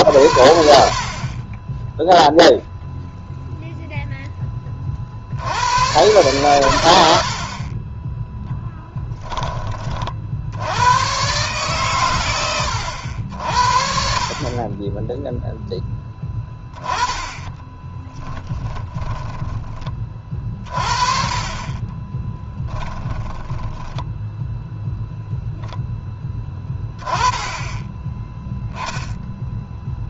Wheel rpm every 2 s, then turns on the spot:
40, 0, 40, 80, 10, 120, 80, 10, 10, 10, 40, 20, 0, 20, 0.
8-10 14-24